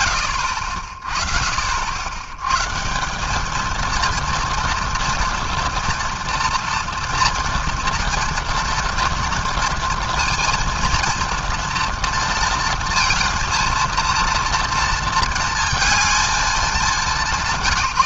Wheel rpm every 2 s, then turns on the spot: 40, 180, 230, 230, 230, 230, 230, 230, 200.
none